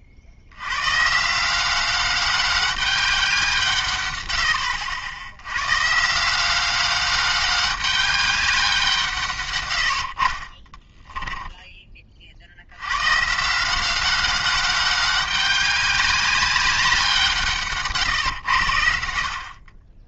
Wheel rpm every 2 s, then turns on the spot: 110, 200, 70, 190, 180, 30, 90, 200, 190, 90.
10-12